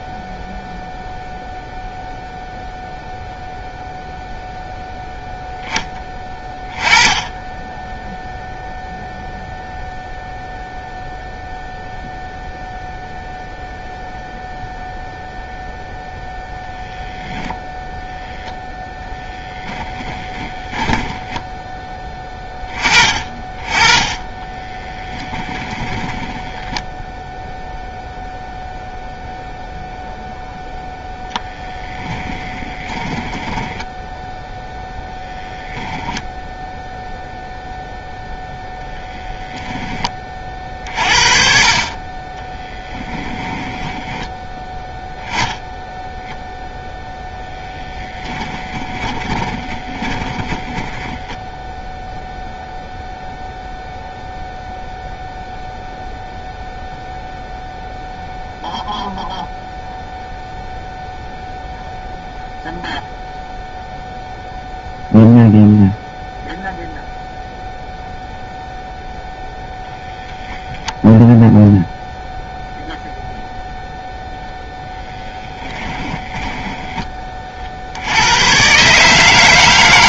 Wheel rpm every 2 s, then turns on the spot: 0, 0, 0, 20, 0, 0, 0, 0, 10, 0, 10, 20, 20, 20, 0, 0, 20, 0, 0, 0, 40, 10, 10, 0, 20, 20, 0, 0, 0, 0, 0, 0, 0, 0, 0, 0, 0, 0, 10, 130.
20-22 24-28 32-34 42-44 48-52 76-78